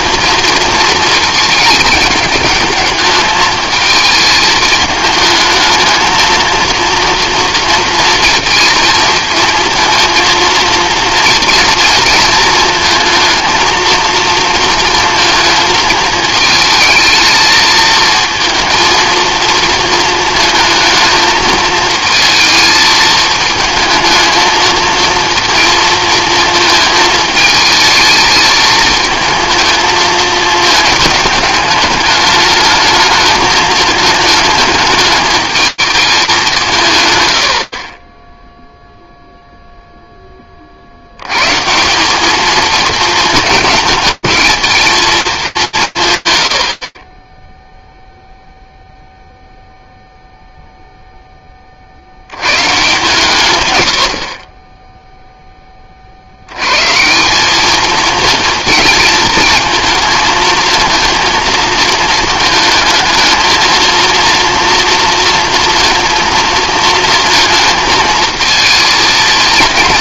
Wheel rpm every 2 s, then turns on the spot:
230, 210, 220, 230, 220, 230, 230, 230, 220, 230, 220, 220, 220, 220, 220, 210, 210, 210, 170, 0, 40, 220, 220, 20, 0, 10, 150, 10, 180, 220, 230, 220, 230, 230, 230.
none